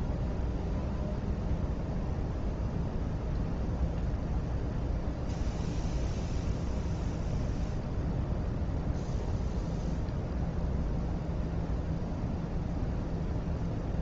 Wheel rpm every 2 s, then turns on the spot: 0, 0, 0, 0, 0, 0, 0.
none